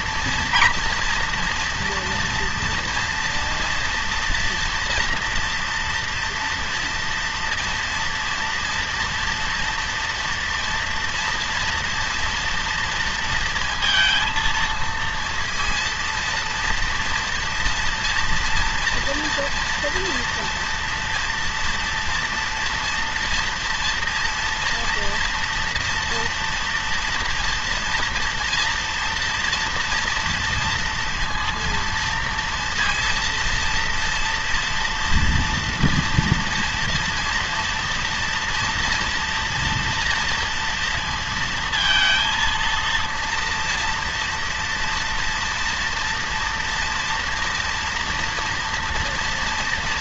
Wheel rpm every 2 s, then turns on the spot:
230, 230, 230, 230, 230, 230, 230, 230, 230, 230, 230, 230, 230, 230, 240, 230, 230, 230, 240, 240, 230, 230, 240, 230, 230.
none